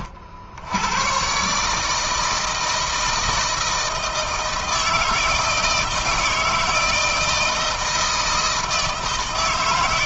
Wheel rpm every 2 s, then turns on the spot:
70, 160, 160, 160, 160.
none